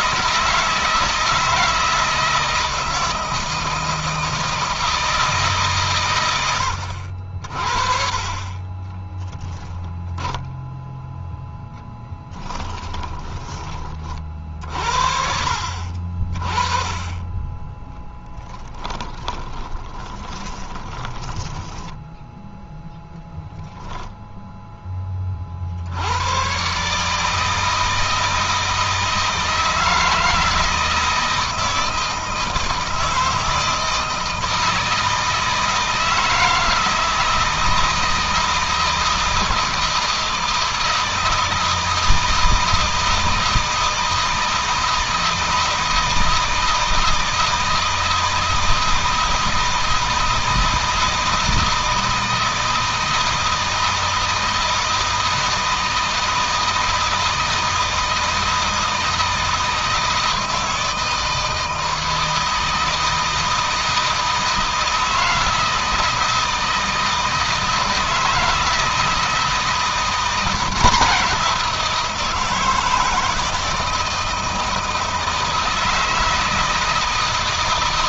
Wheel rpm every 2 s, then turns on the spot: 160, 160, 160, 60, 20, 10, 10, 60, 20, 10, 20, 10, 10, 140, 160, 160, 160, 160, 160, 160, 160, 160, 160, 160, 160, 160, 160, 160, 160, 160, 160, 160, 160, 160, 160, 180, 160, 160, 160.
8-10 12-14 18-22